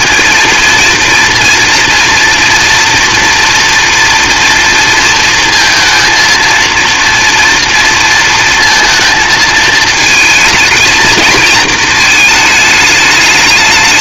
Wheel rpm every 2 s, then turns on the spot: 230, 230, 230, 230, 230, 220, 210.
none